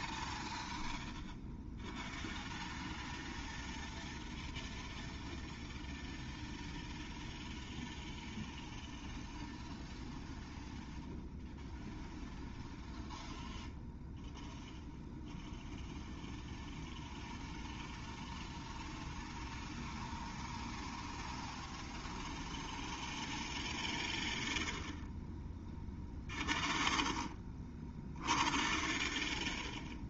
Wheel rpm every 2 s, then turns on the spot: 0, 0, 0, 0, 0, 0, 0, 0, 0, 0, 0, 0, 0, 0, 0.
none